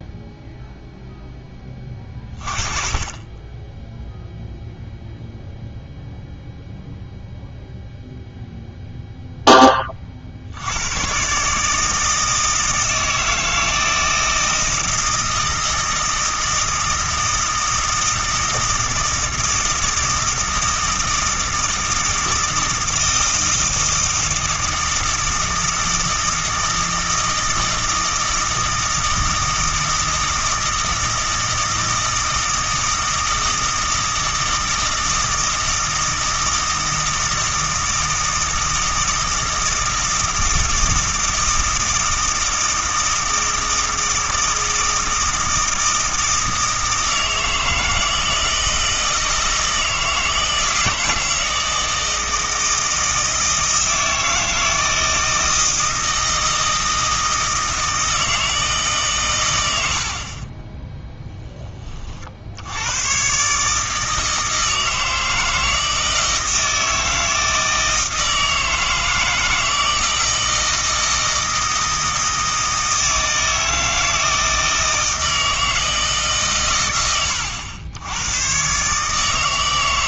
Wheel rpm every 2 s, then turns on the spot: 0, 30, 0, 0, 0, 80, 160, 160, 160, 160, 160, 160, 160, 160, 160, 160, 160, 160, 160, 160, 160, 160, 160, 160, 160, 160, 160, 160, 160, 150, 20, 90, 160, 160, 160, 160, 160, 160, 130, 130.
60-62